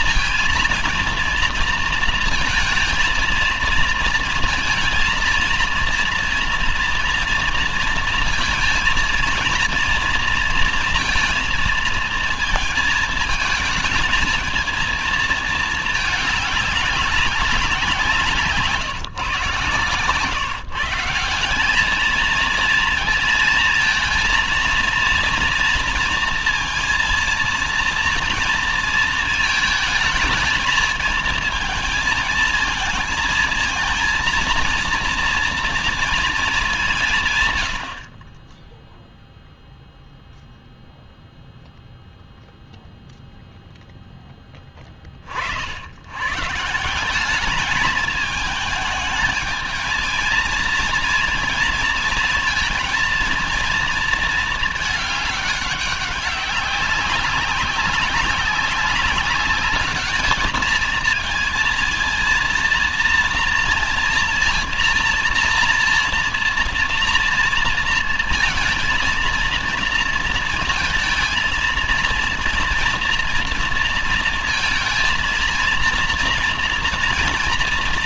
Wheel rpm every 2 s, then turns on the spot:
230, 230, 230, 230, 230, 230, 220, 220, 200, 140, 160, 230, 230, 230, 230, 220, 220, 230, 160, 0, 0, 0, 30, 180, 220, 230, 220, 210, 200, 200, 220, 230, 230, 230, 230, 230, 230, 220, 230.
none